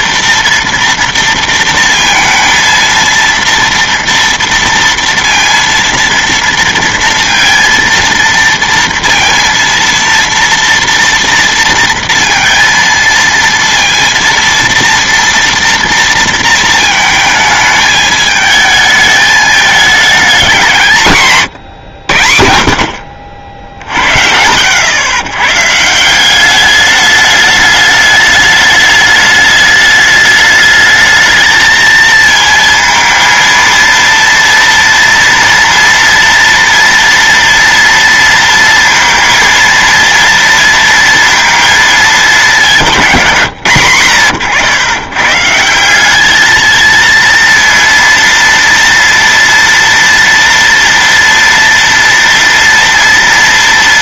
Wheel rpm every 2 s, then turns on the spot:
230, 230, 230, 230, 230, 230, 230, 230, 230, 220, 190, 70, 100, 200, 210, 210, 230, 230, 230, 230, 230, 200, 110, 220, 230, 230, 230.
none